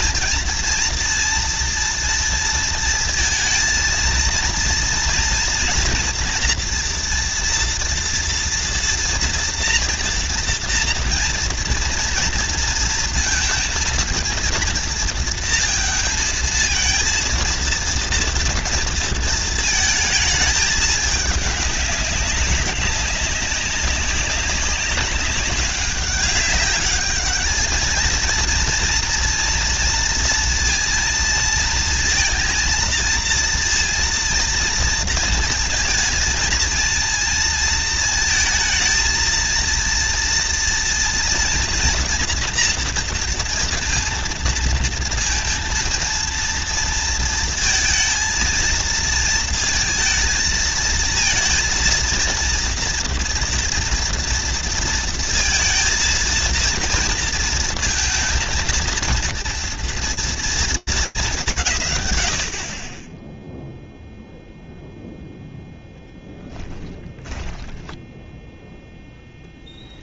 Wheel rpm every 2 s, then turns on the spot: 230, 230, 230, 230, 240, 230, 230, 230, 220, 230, 210, 200, 200, 200, 230, 230, 230, 230, 230, 230, 230, 230, 230, 230, 230, 220, 230, 230, 230, 230, 230, 20, 0, 10, 0.
66-68